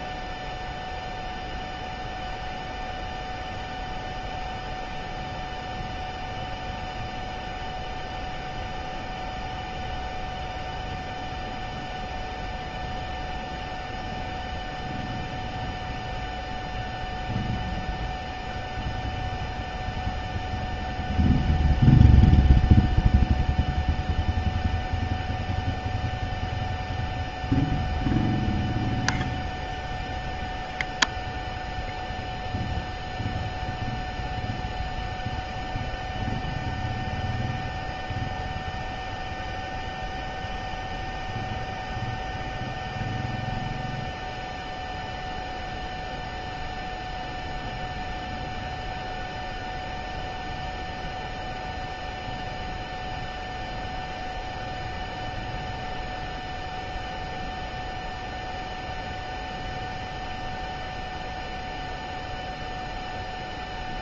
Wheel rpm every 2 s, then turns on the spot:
0, 0, 0, 0, 0, 0, 0, 0, 0, 0, 0, 0, 0, 0, 0, 0, 0, 0, 0, 0, 0, 0, 0, 0, 0, 0, 0, 0, 0, 0, 0, 0.
none